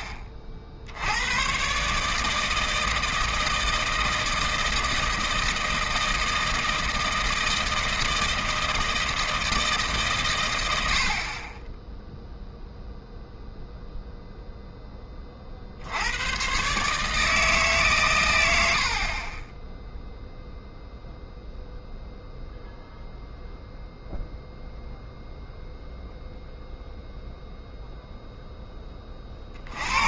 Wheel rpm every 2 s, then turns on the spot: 60, 160, 160, 160, 160, 100, 0, 0, 130, 80, 0, 0, 0, 0, 10.
none